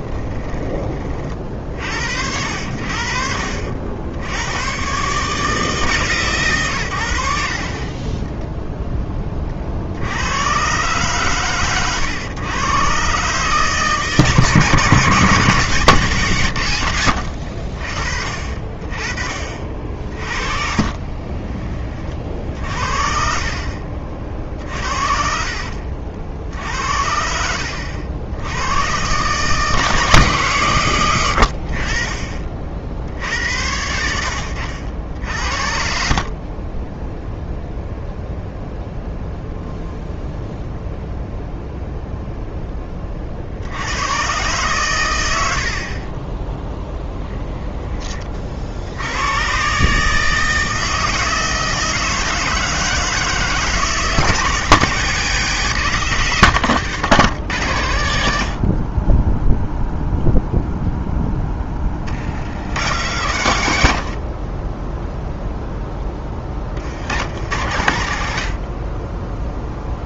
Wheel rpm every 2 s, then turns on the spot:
30, 60, 130, 110, 10, 130, 130, 160, 100, 40, 40, 50, 50, 70, 100, 140, 40, 80, 30, 0, 0, 0, 120, 10, 50, 160, 160, 150, 150, 70, 0, 90, 30, 30, 70.
20-22 24-26 36-38 64-66